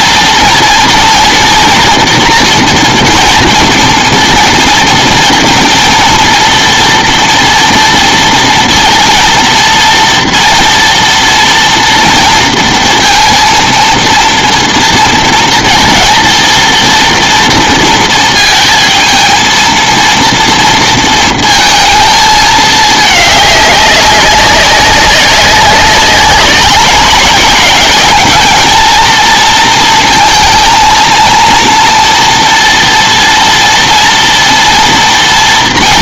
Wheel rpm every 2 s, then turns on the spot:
230, 240, 230, 230, 230, 230, 230, 230, 230, 230, 230, 220, 200, 190, 220, 230, 240, 230.
none